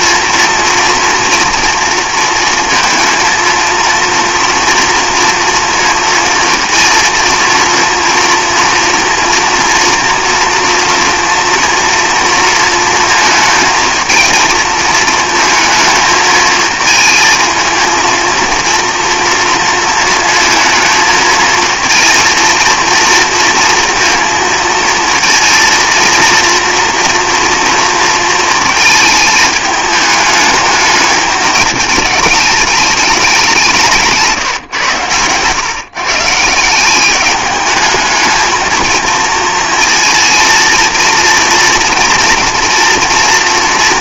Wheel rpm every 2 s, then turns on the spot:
240, 230, 230, 230, 230, 230, 230, 220, 220, 230, 220, 230, 230, 230, 220, 210, 210, 130, 170, 220, 230, 240.
none